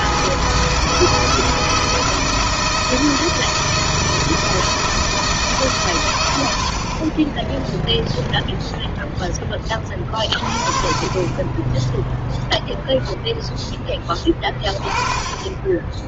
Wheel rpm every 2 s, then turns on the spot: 160, 160, 160, 70, 0, 40, 0, 30.
10-12